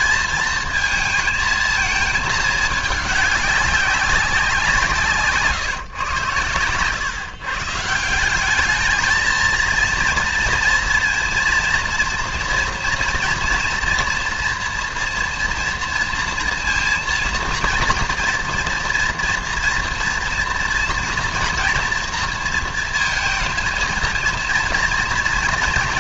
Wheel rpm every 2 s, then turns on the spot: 220, 210, 180, 120, 210, 230, 240, 240, 230, 240, 240, 230, 230.
none